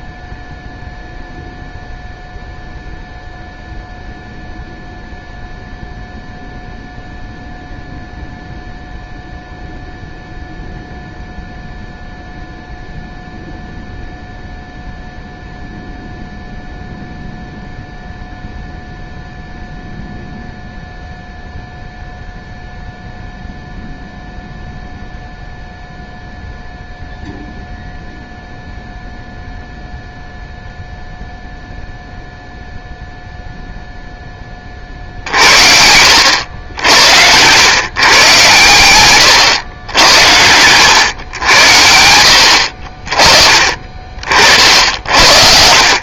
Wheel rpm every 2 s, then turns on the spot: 0, 0, 0, 0, 0, 0, 0, 0, 0, 0, 0, 0, 0, 0, 0, 0, 0, 40, 80, 120, 110, 50, 60.
42-44